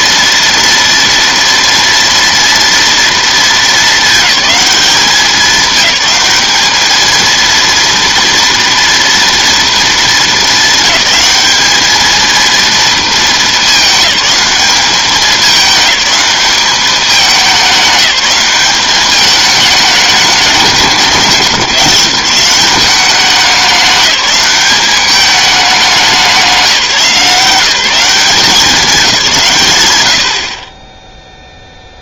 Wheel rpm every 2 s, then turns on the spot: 230, 230, 210, 210, 230, 220, 230, 200, 200, 190, 190, 190, 190, 190, 190, 30.
none